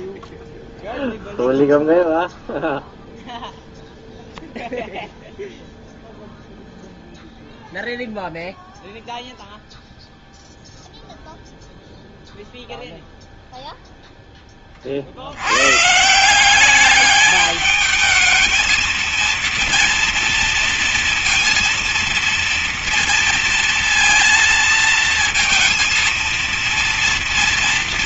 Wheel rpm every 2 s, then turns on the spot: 0, 0, 0, 0, 0, 0, 0, 10, 150, 220, 230, 230, 230, 230.
none